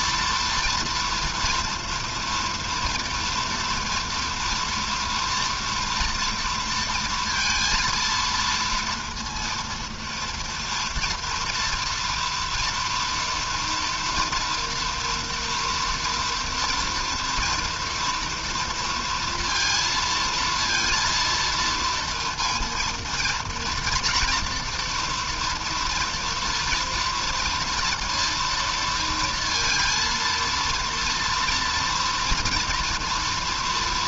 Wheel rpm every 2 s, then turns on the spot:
230, 230, 230, 230, 230, 230, 230, 230, 230, 230, 230, 230, 230, 230, 230, 230, 220.
none